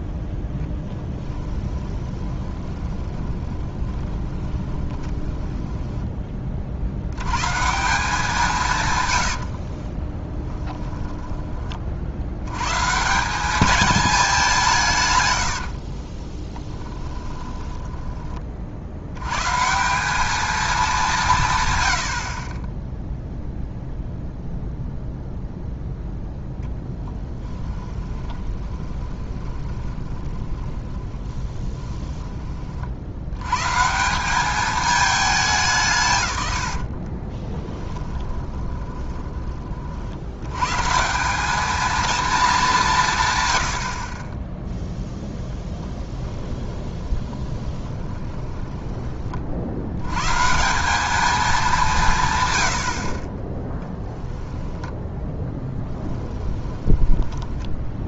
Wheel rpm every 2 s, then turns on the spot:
10, 20, 20, 40, 150, 10, 130, 160, 10, 50, 210, 20, 0, 10, 20, 30, 40, 210, 80, 30, 130, 200, 0, 20, 10, 180, 100, 10, 10.
2-6 10-12 16-18 28-32 36-40 46-50 54-58